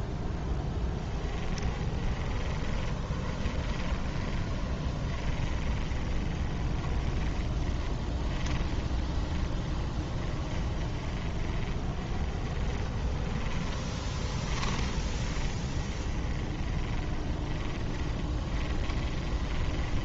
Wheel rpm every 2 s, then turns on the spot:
10, 20, 20, 20, 20, 10, 20, 20, 20, 20.
0-20